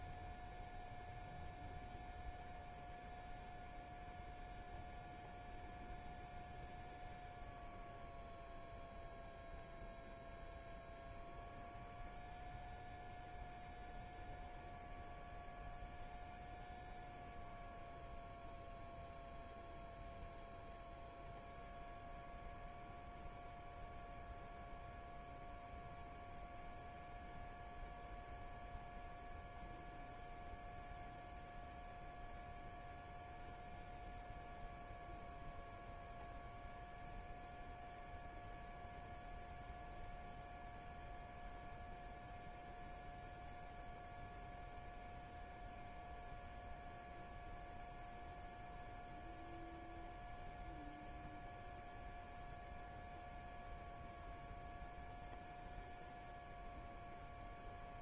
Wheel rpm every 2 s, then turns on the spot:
0, 0, 0, 0, 0, 0, 0, 0, 0, 0, 0, 0, 0, 0, 0, 0, 0, 0, 0, 0, 0, 0, 0, 0, 0, 0, 0, 0, 0.
none